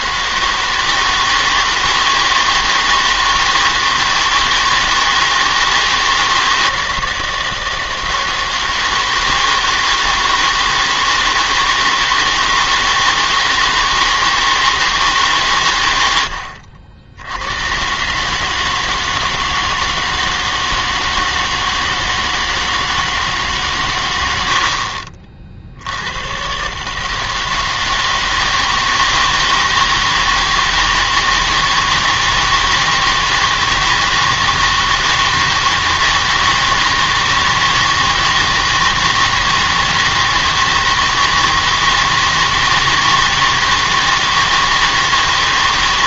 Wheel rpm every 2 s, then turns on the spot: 160, 160, 160, 160, 160, 160, 160, 160, 70, 150, 160, 160, 70, 130, 160, 160, 160, 160, 160, 160, 160, 160, 160.
16-18 24-26